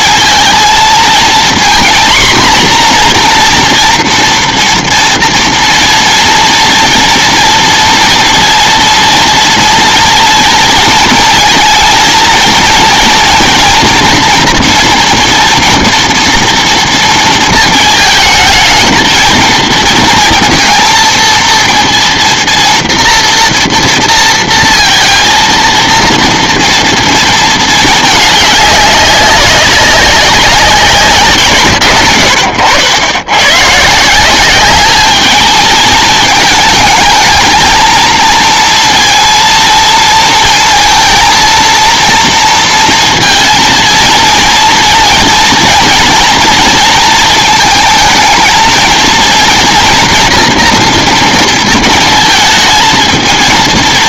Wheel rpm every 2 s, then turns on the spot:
230, 250, 240, 230, 230, 230, 230, 240, 230, 220, 230, 230, 230, 230, 200, 170, 60, 200, 220, 230, 230, 230, 230, 230, 220, 240, 220.
none